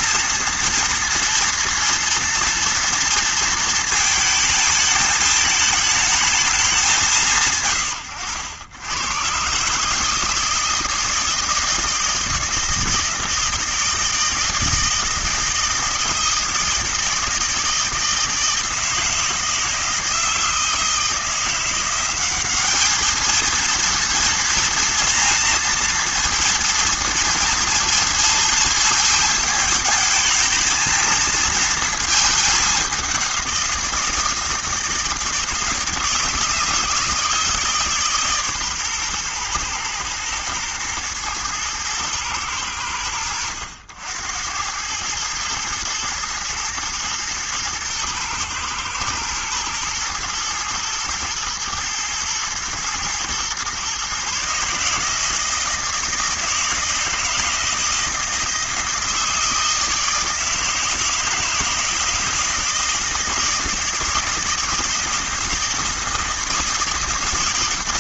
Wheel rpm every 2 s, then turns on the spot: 230, 230, 220, 200, 90, 160, 160, 160, 160, 160, 160, 210, 230, 230, 230, 220, 200, 160, 160, 130, 120, 100, 100, 120, 110, 110, 110, 150, 160, 160, 160, 160, 160, 160.
none